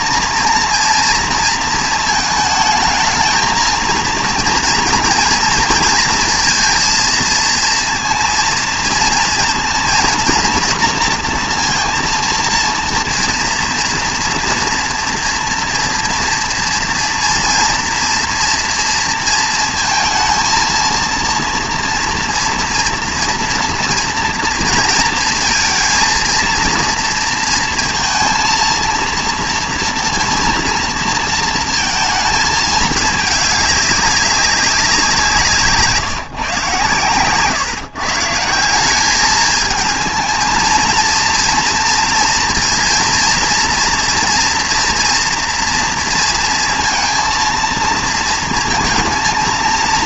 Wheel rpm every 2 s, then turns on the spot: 230, 220, 230, 230, 230, 230, 230, 230, 230, 240, 230, 230, 230, 230, 230, 230, 220, 190, 140, 180, 230, 230, 230, 230, 230.
none